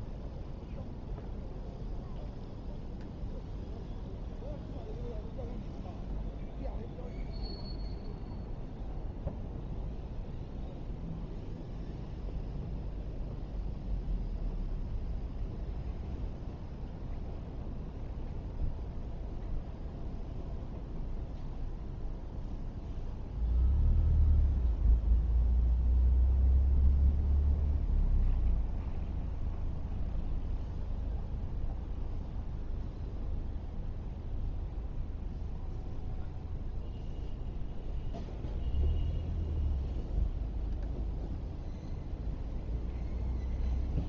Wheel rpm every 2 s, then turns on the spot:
0, 0, 0, 0, 0, 0, 0, 0, 0, 0, 0, 0, 0, 0, 0, 0, 0, 0, 0, 0, 0, 0.
none